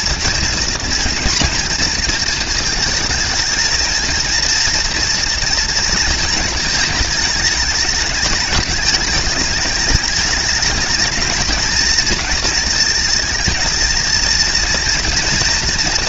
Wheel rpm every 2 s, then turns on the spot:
240, 220, 230, 220, 210, 220, 220, 230.
none